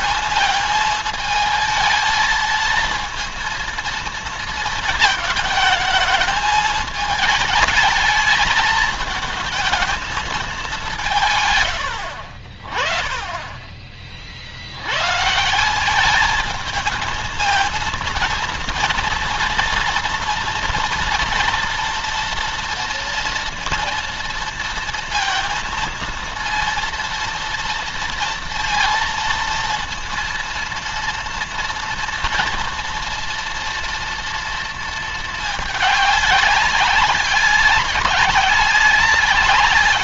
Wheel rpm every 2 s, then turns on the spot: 220, 220, 220, 210, 220, 210, 50, 70, 220, 230, 230, 230, 230, 230, 230, 230, 230, 230, 200, 200.
none